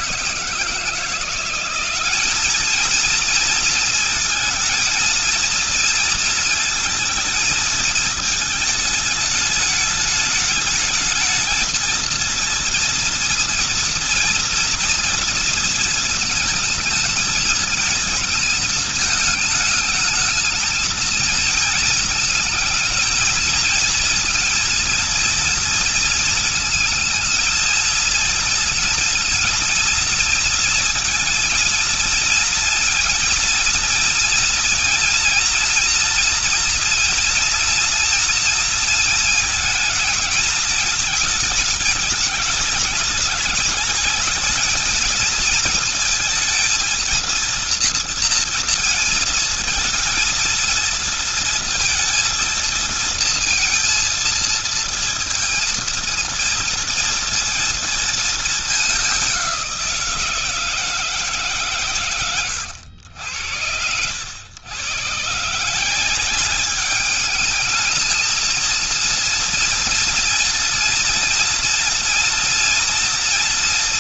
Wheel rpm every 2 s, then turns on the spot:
160, 200, 220, 230, 220, 210, 230, 230, 230, 220, 220, 220, 230, 230, 230, 230, 230, 230, 230, 230, 230, 210, 220, 220, 230, 230, 230, 230, 230, 220, 160, 110, 120, 200, 230, 230, 230.
none